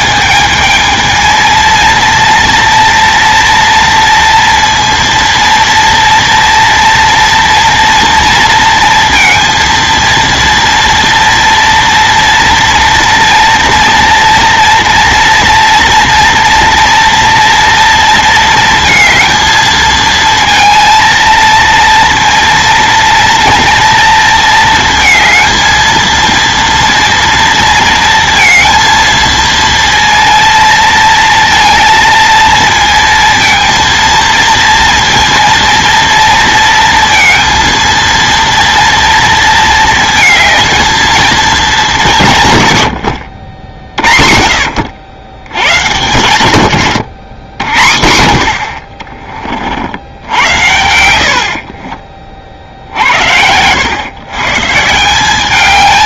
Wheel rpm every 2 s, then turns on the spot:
220, 230, 230, 230, 230, 230, 230, 230, 230, 230, 230, 230, 220, 230, 230, 230, 230, 230, 230, 230, 220, 140, 70, 110, 60, 90, 50, 130.
46-48